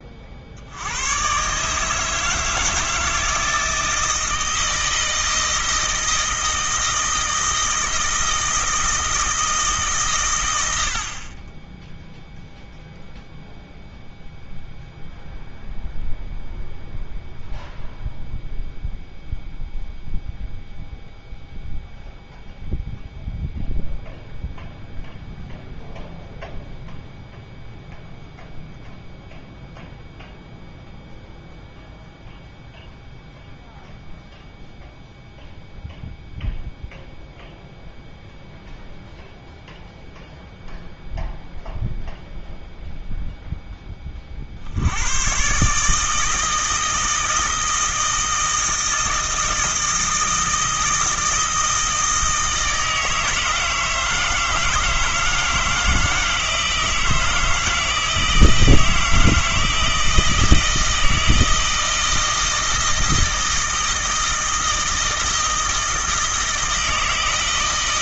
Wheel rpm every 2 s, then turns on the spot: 80, 160, 160, 160, 160, 90, 0, 0, 0, 0, 0, 0, 0, 0, 0, 0, 0, 0, 0, 0, 0, 0, 70, 160, 160, 160, 160, 160, 160, 160, 160, 160, 160, 160.
none